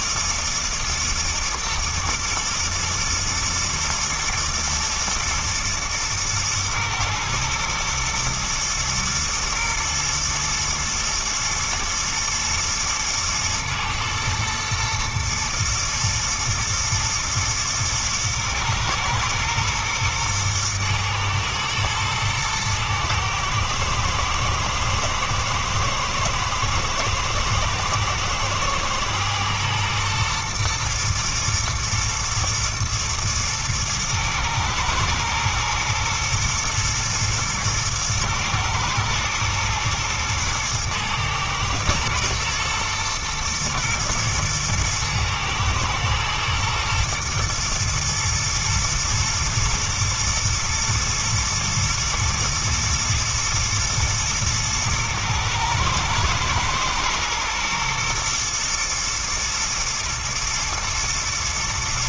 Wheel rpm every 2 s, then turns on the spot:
110, 110, 120, 120, 110, 110, 110, 120, 110, 110, 120, 110, 110, 110, 120, 120, 120, 110, 120, 110, 110, 120, 110, 120, 110, 120, 120, 110, 110, 120, 110.
none